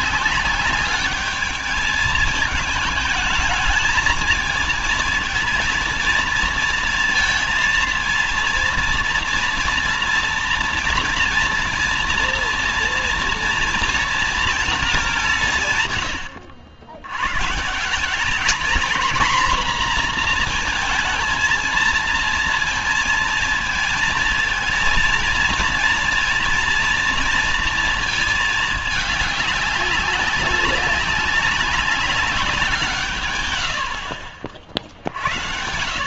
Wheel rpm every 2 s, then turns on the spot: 200, 220, 220, 230, 230, 230, 230, 230, 80, 210, 230, 230, 230, 230, 220, 200, 180, 60.
none